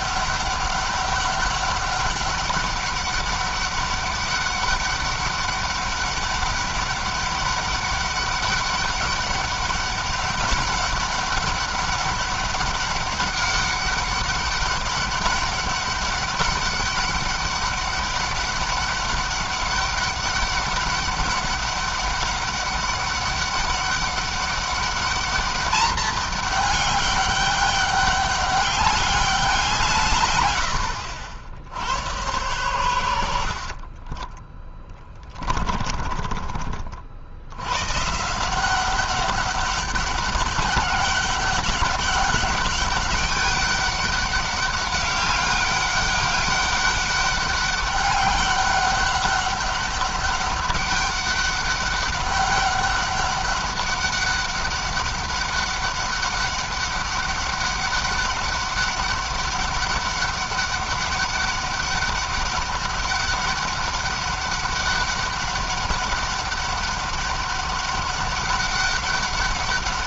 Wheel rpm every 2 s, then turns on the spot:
200, 200, 200, 200, 200, 200, 200, 200, 200, 200, 200, 200, 200, 210, 200, 90, 100, 10, 50, 180, 200, 200, 200, 200, 200, 200, 200, 200, 200, 200, 200, 200, 200, 200, 200.
32-36